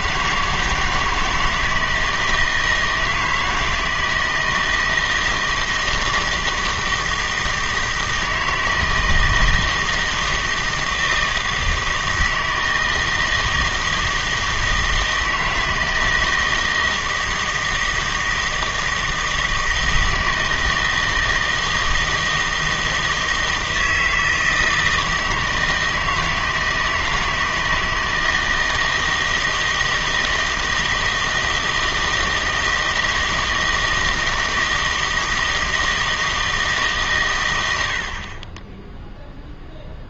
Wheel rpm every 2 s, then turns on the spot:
160, 160, 160, 160, 160, 160, 160, 160, 160, 160, 160, 160, 160, 160, 160, 160, 160, 160, 150, 20.
none